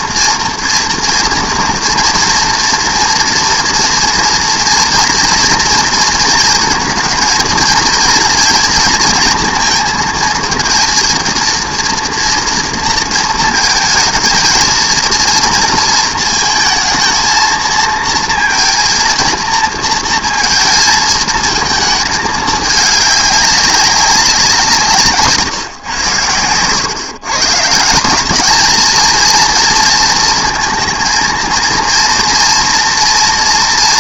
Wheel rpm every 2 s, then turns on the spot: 230, 230, 240, 230, 240, 230, 240, 220, 220, 230, 230, 210, 180, 110, 220, 220, 230.
none